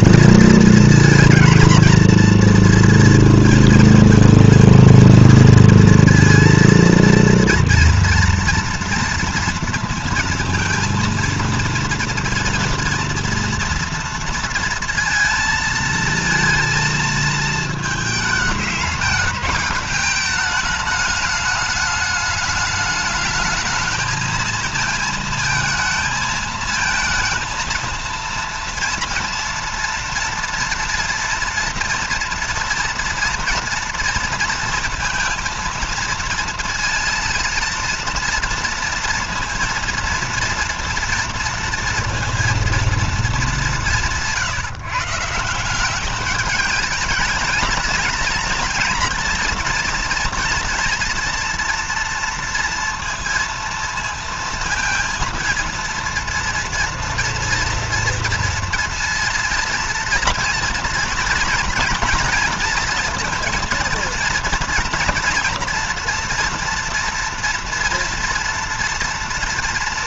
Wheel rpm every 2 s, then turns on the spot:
230, 230, 230, 230, 230, 230, 240, 230, 230, 210, 210, 210, 230, 230, 230, 230, 230, 220, 230, 230, 230, 230, 150, 210, 230, 230, 230, 230, 230, 230, 240, 240, 230, 230, 230.
none